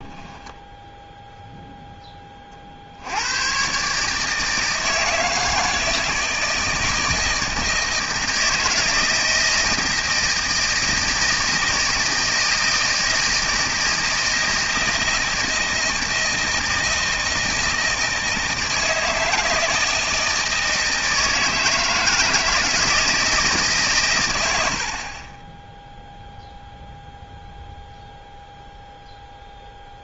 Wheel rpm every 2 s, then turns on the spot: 10, 60, 160, 160, 160, 160, 160, 160, 160, 160, 160, 160, 60, 0, 0.
none